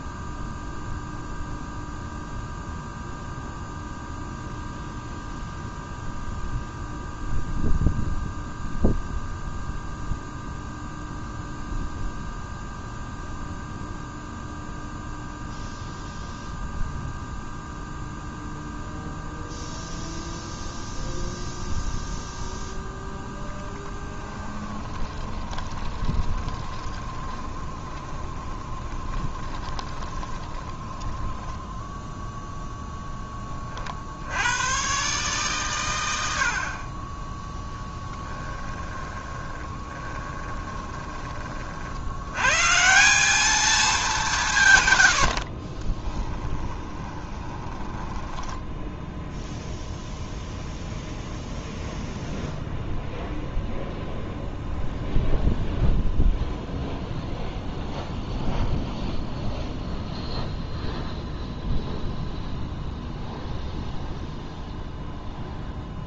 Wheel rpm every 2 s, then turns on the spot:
0, 0, 0, 0, 0, 0, 0, 0, 0, 0, 0, 0, 20, 20, 20, 10, 0, 120, 40, 20, 20, 160, 120, 20, 0, 0, 0, 0, 0, 0, 0, 0, 0.
24-32 38-42 46-48